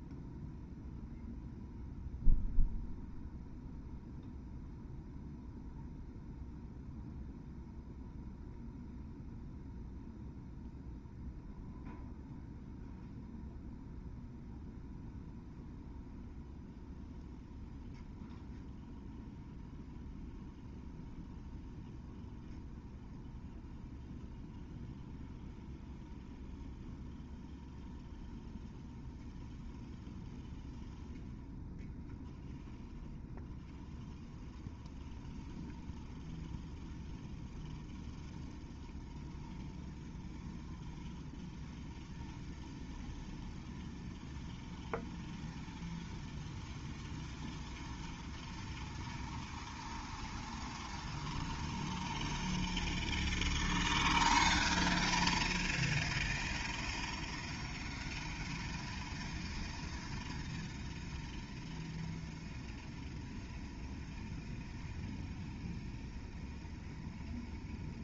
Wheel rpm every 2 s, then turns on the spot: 0, 0, 0, 0, 0, 0, 0, 0, 0, 0, 0, 0, 0, 0, 0, 0, 0, 0, 0, 0, 0, 0, 0, 0, 0, 0, 0, 0, 0, 0, 0, 0, 0, 0.
none